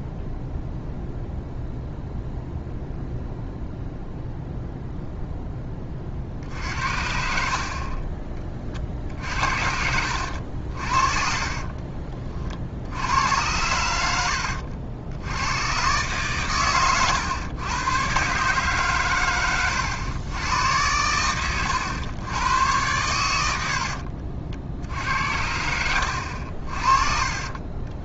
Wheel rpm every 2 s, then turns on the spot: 0, 0, 0, 60, 30, 60, 60, 70, 120, 140, 100, 110, 60, 60.
none